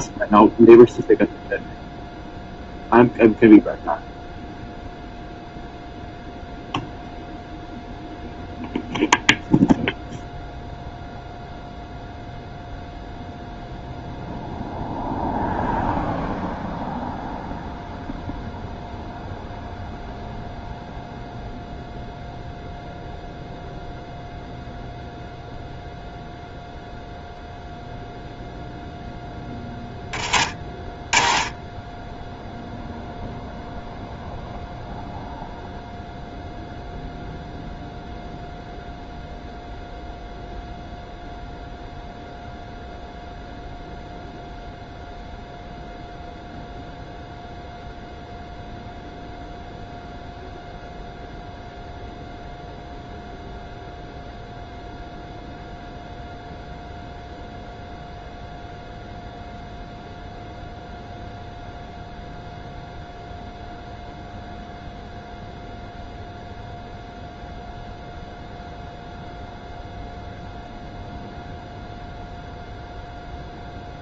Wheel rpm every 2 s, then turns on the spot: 0, 0, 0, 0, 0, 0, 0, 0, 0, 0, 0, 0, 0, 0, 0, 20, 0, 0, 0, 0, 0, 0, 0, 0, 0, 0, 0, 0, 0, 0, 0, 0, 0, 0, 0, 0, 0.
none